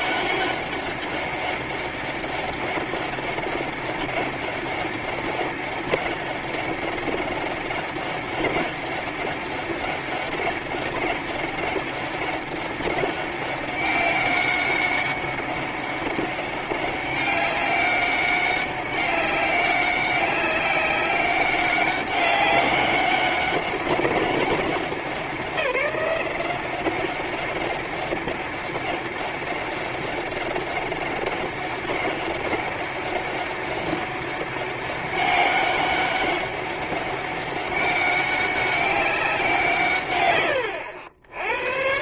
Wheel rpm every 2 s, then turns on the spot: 200, 200, 190, 200, 190, 200, 190, 200, 200, 200, 190, 200, 190, 190, 190, 190, 200, 200, 200, 200, 80.
none